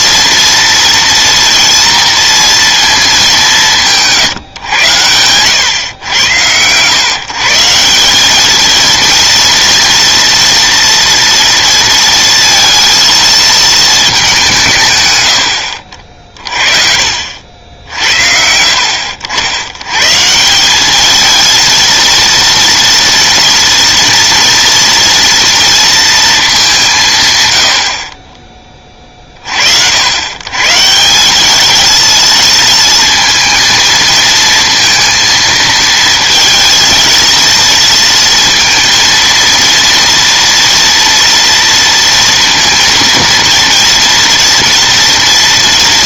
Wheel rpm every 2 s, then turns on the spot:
230, 230, 120, 110, 220, 230, 230, 150, 40, 70, 180, 230, 230, 200, 20, 150, 230, 230, 230, 230, 230, 230, 230.
none